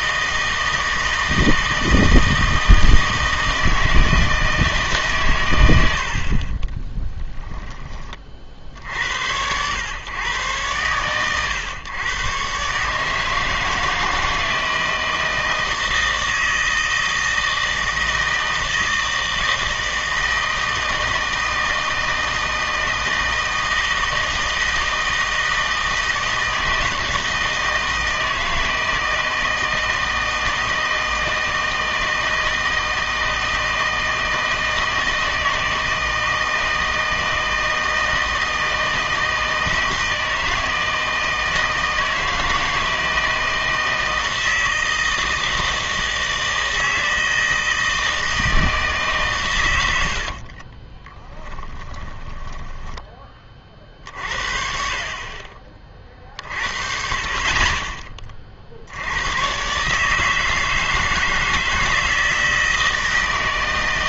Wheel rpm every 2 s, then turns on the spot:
160, 160, 160, 30, 60, 110, 140, 160, 160, 160, 160, 160, 160, 160, 160, 160, 160, 160, 160, 160, 160, 160, 160, 160, 160, 40, 10, 60, 50, 50, 160, 160.
6-8 50-54